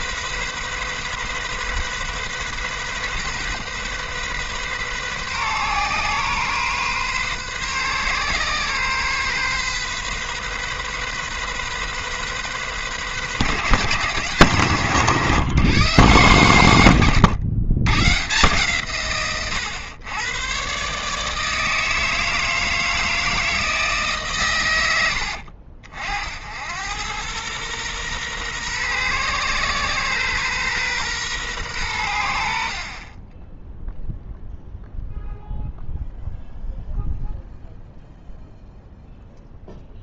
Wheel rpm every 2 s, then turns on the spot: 130, 130, 130, 130, 130, 130, 130, 120, 130, 140, 140, 160, 130, 90, 120, 120, 60, 0, 0, 0.
none